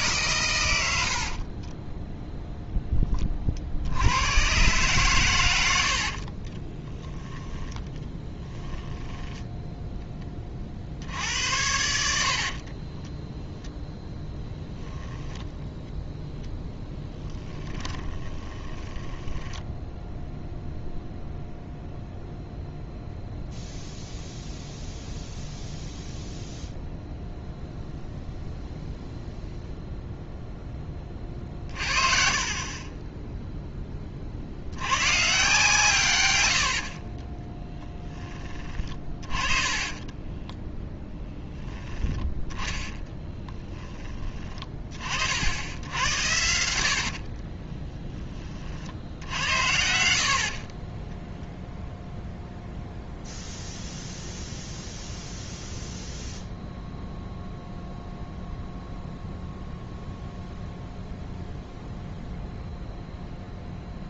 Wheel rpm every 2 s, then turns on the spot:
100, 0, 120, 20, 10, 40, 40, 10, 10, 20, 0, 0, 0, 0, 0, 10, 30, 90, 80, 30, 10, 10, 30, 70, 40, 40, 0, 0, 0, 0, 0, 0.
6-8 12-20 36-40 42-44 46-48 50-52